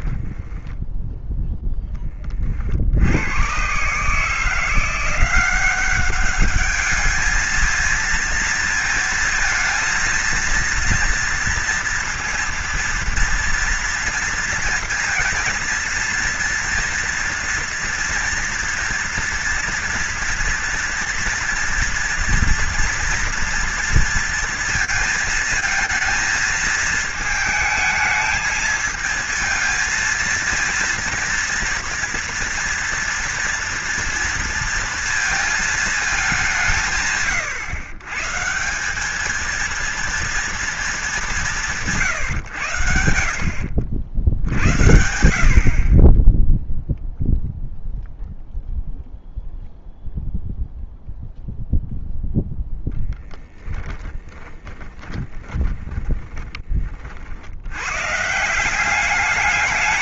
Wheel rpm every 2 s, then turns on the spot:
10, 70, 170, 210, 230, 230, 230, 230, 230, 230, 230, 230, 230, 220, 220, 230, 240, 230, 180, 180, 220, 90, 80, 0, 0, 0, 0, 20, 30, 180.
0-2 54-56